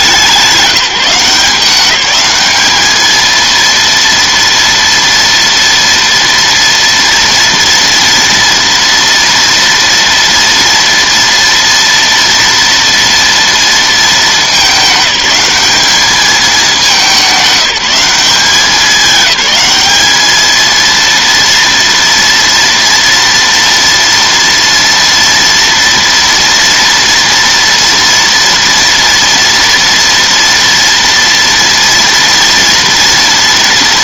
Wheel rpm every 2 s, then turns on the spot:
190, 210, 230, 230, 230, 230, 230, 210, 200, 190, 220, 230, 230, 230, 230, 230, 230.
none